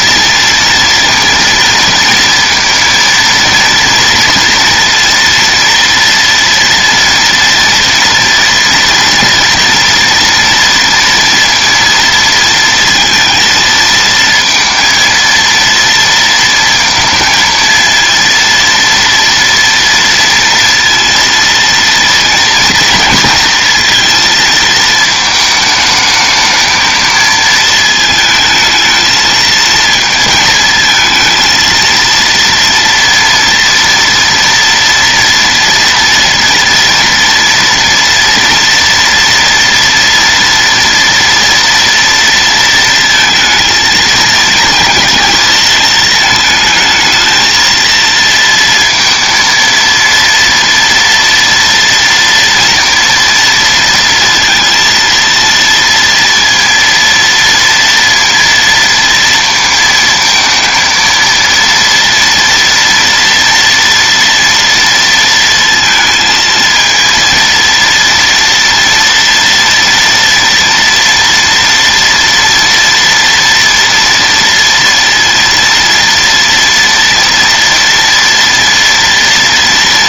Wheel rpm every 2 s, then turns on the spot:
230, 230, 230, 230, 230, 230, 230, 230, 230, 230, 230, 230, 230, 220, 220, 220, 240, 230, 230, 230, 230, 230, 230, 220, 230, 230, 230, 230, 230, 230, 230, 230, 230, 230, 230, 230, 230, 230, 230, 230.
none